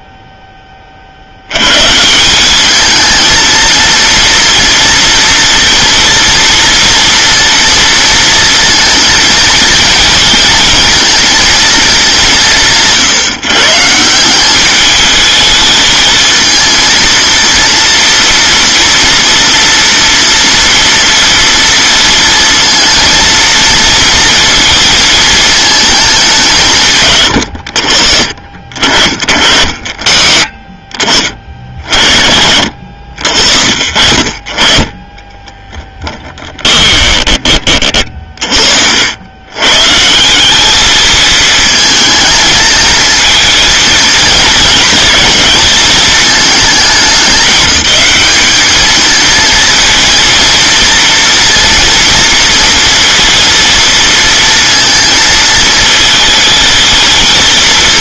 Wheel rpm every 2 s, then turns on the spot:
20, 200, 230, 230, 230, 230, 170, 200, 230, 230, 230, 230, 230, 170, 50, 40, 70, 40, 10, 60, 200, 220, 230, 210, 220, 230, 230, 230, 220.
36-38